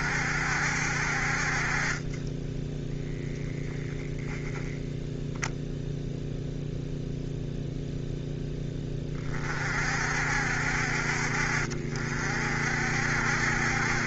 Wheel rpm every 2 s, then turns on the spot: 70, 10, 10, 0, 10, 60, 60.
none